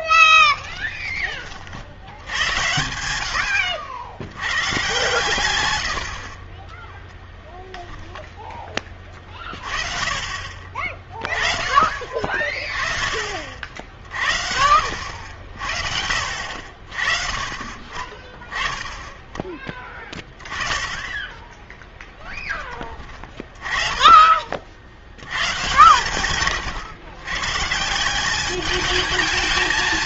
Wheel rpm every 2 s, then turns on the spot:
10, 90, 120, 20, 20, 40, 30, 70, 60, 10, 20, 30, 60, 130, 210.
0-2